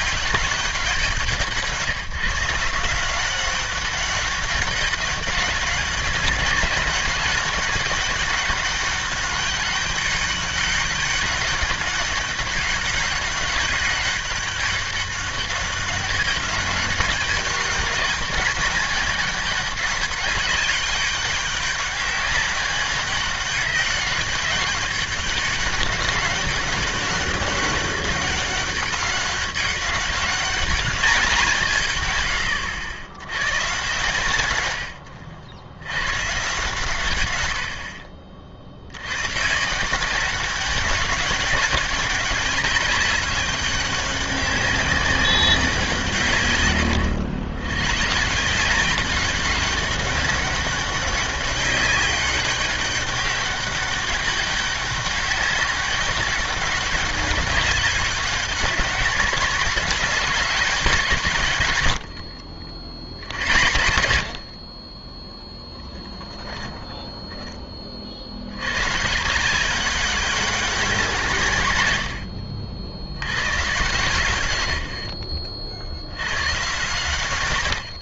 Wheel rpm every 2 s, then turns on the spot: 180, 160, 200, 200, 200, 200, 200, 200, 200, 200, 200, 200, 200, 200, 200, 210, 80, 100, 140, 60, 200, 210, 200, 110, 180, 200, 200, 200, 200, 190, 180, 70, 50, 10, 100, 190, 70, 100, 110.
66-68